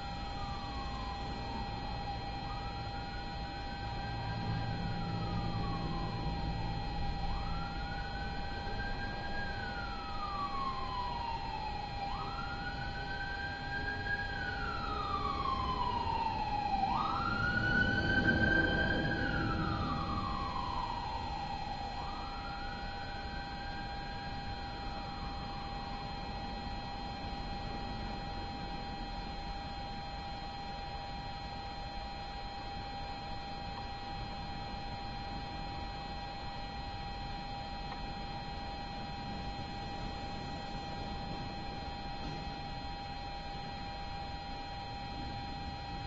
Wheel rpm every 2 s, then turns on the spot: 0, 0, 0, 0, 0, 0, 0, 0, 0, 0, 0, 0, 0, 0, 0, 0, 0, 0, 0, 0, 0, 0, 0.
none